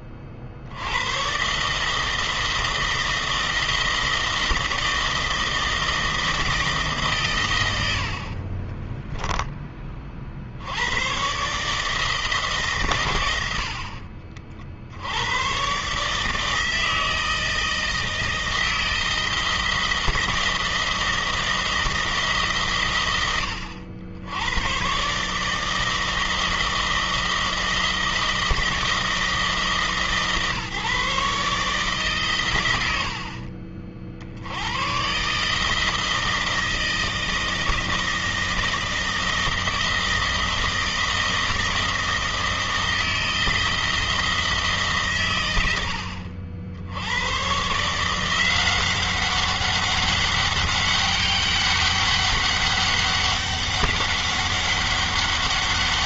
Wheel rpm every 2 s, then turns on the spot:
100, 160, 160, 140, 20, 110, 120, 80, 160, 160, 160, 120, 130, 160, 160, 150, 90, 130, 160, 160, 160, 160, 130, 90, 190, 200, 200, 200.
8-10